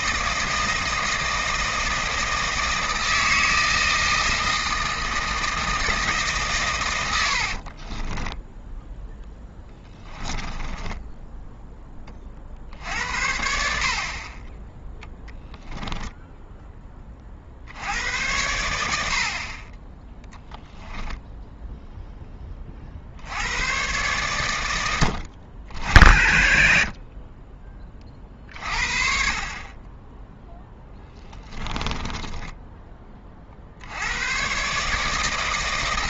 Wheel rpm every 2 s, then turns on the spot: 160, 160, 160, 110, 10, 10, 60, 10, 10, 80, 10, 50, 100, 50, 40, 10, 20, 140.
10-12 20-22 30-32